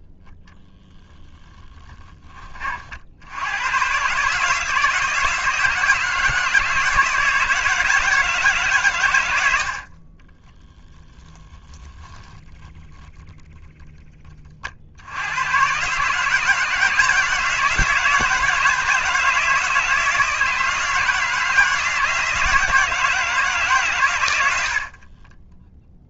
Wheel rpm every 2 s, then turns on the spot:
0, 50, 160, 160, 130, 10, 10, 60, 160, 160, 160, 160, 60.
none